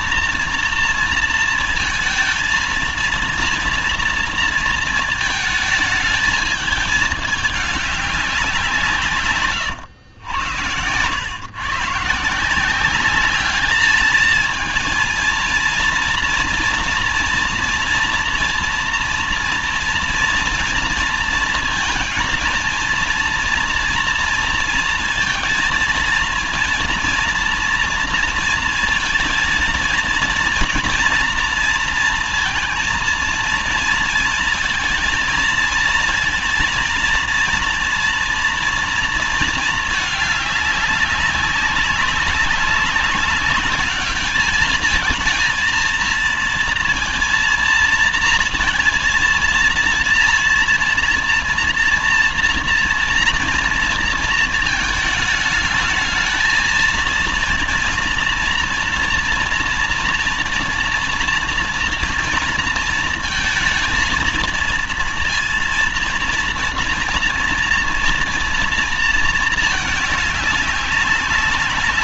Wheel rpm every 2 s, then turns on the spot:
240, 230, 230, 220, 180, 100, 180, 220, 240, 240, 230, 230, 230, 230, 230, 230, 230, 230, 230, 230, 210, 200, 210, 230, 230, 230, 230, 230, 220, 230, 230, 230, 230, 230, 230, 200.
10-12